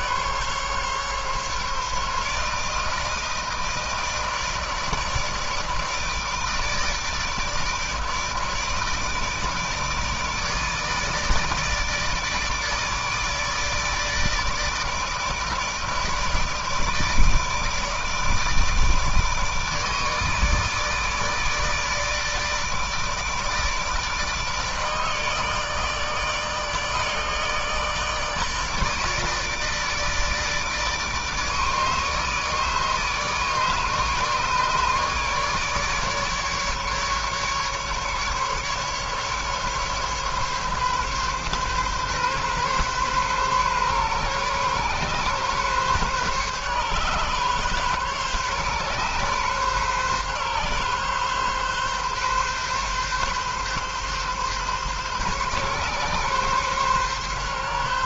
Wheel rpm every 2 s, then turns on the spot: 140, 160, 160, 150, 150, 160, 150, 160, 160, 150, 160, 160, 150, 150, 160, 160, 150, 150, 150, 140, 140, 130, 130, 140, 140, 140, 130, 140, 140.
none